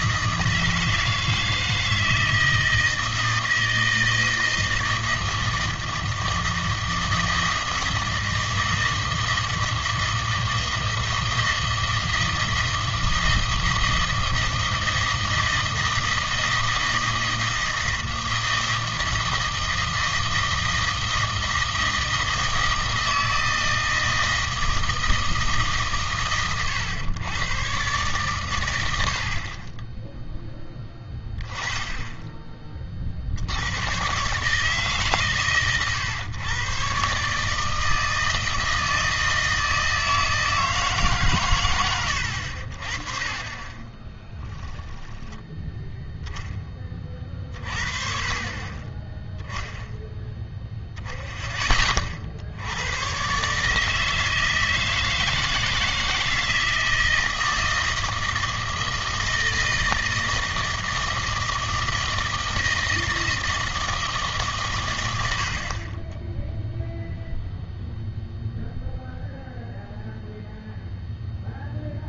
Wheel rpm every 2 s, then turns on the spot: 160, 160, 160, 160, 160, 160, 160, 160, 160, 160, 160, 160, 160, 110, 100, 10, 30, 150, 110, 160, 160, 60, 10, 10, 30, 0, 90, 160, 160, 160, 160, 160, 130, 0, 0, 0.
44-46